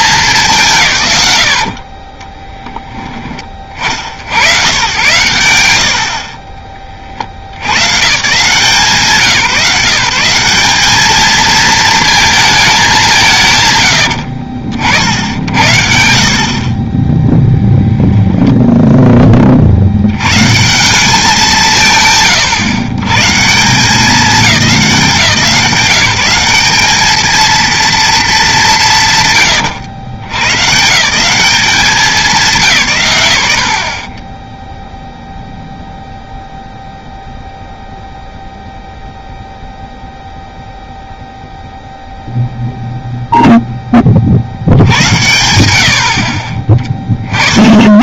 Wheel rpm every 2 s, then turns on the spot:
170, 10, 120, 40, 160, 190, 210, 90, 30, 10, 170, 100, 170, 200, 200, 120, 140, 0, 0, 0, 0, 0, 90, 30.
18-20